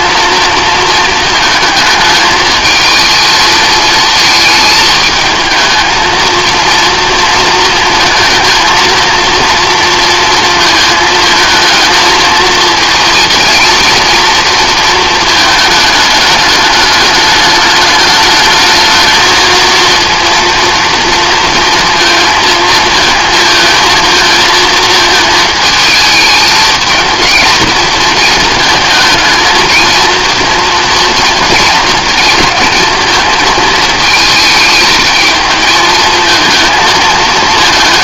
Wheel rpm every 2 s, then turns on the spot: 230, 220, 220, 230, 230, 220, 230, 230, 210, 220, 230, 230, 220, 220, 220, 230, 220, 220, 220.
none